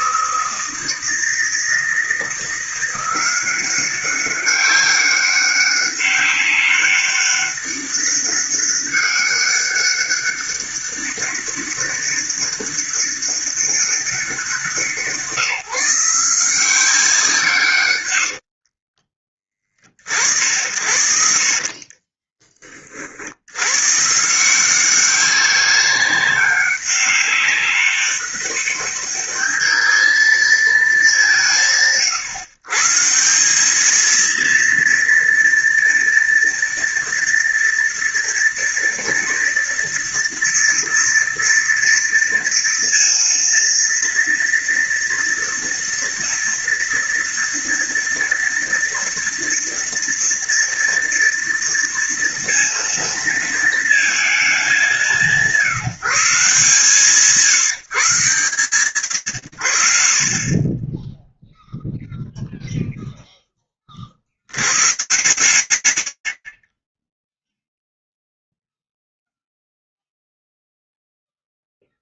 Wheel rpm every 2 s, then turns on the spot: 160, 170, 200, 200, 200, 200, 200, 190, 180, 70, 70, 30, 170, 200, 200, 220, 140, 230, 230, 230, 230, 230, 230, 230, 230, 230, 230, 190, 170, 140, 30, 0, 90, 40, 0, 0.
18-20